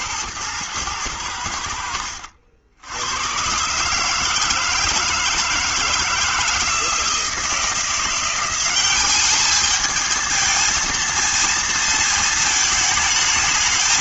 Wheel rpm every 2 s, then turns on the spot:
110, 80, 160, 160, 190, 220, 220.
none